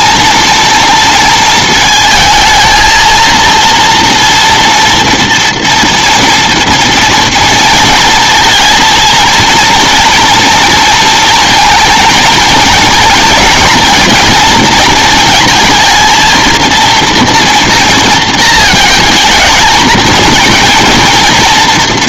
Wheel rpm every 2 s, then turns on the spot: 230, 220, 230, 230, 230, 230, 230, 230, 230, 230, 230.
none